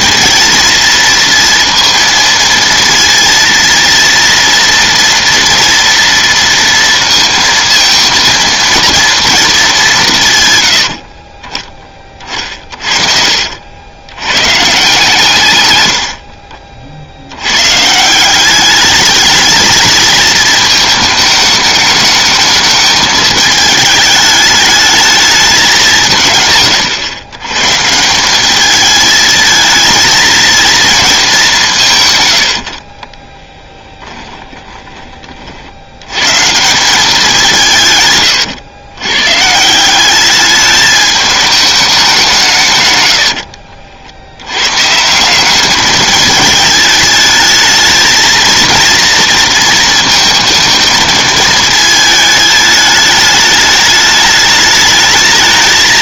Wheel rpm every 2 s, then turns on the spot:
230, 230, 230, 230, 230, 110, 50, 130, 60, 190, 220, 210, 210, 130, 210, 230, 60, 20, 160, 110, 210, 140, 120, 220, 230, 230, 210, 210.
34-36